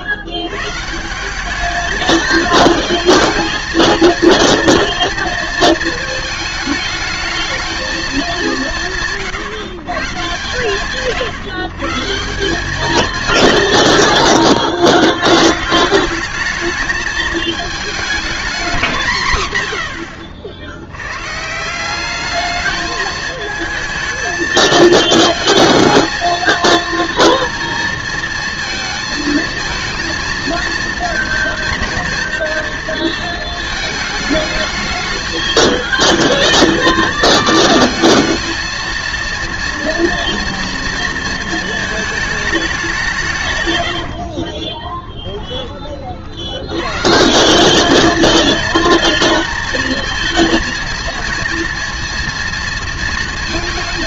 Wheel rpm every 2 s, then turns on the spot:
130, 220, 230, 220, 170, 130, 210, 90, 210, 200, 90, 220, 230, 230, 220, 230, 230, 220, 220, 230, 230, 200, 30, 100, 230, 230, 230.
44-46